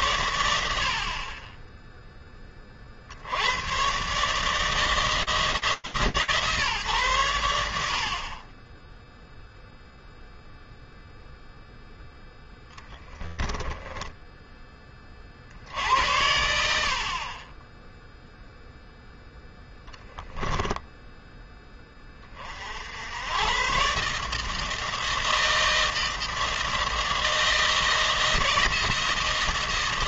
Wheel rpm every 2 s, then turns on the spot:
90, 40, 150, 140, 20, 0, 10, 40, 40, 0, 10, 90, 160, 160, 160.
12-14